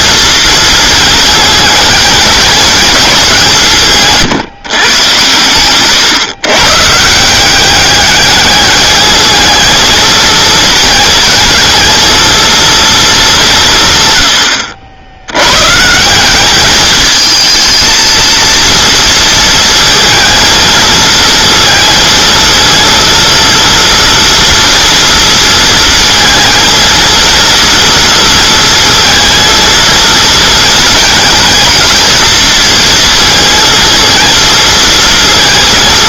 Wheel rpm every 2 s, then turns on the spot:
230, 210, 130, 140, 210, 220, 230, 70, 200, 230, 220, 230, 230, 230, 230, 230, 230, 230.
none